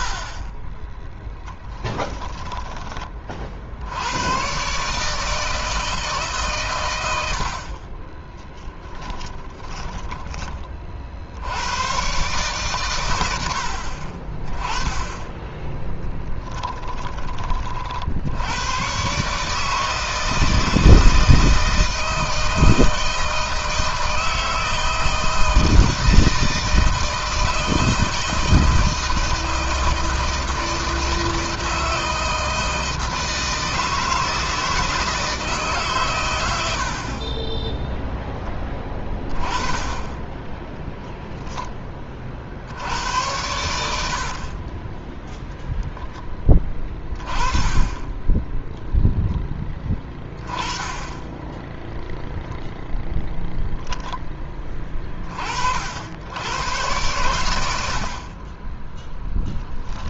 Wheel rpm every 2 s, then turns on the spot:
20, 20, 130, 110, 10, 40, 120, 20, 20, 100, 160, 160, 160, 160, 160, 160, 160, 160, 70, 20, 10, 80, 20, 30, 0, 10, 0, 30, 110, 10.
8-10 40-42 44-46